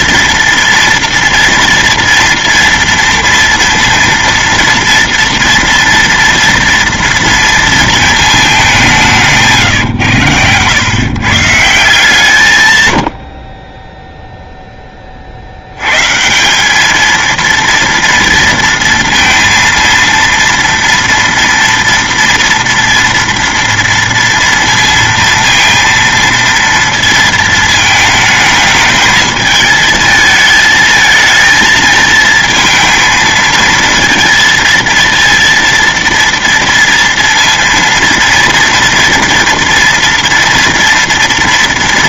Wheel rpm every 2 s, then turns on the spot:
230, 230, 230, 230, 200, 130, 110, 10, 210, 230, 230, 230, 230, 230, 220, 220, 230, 230, 230, 230, 230.
12-14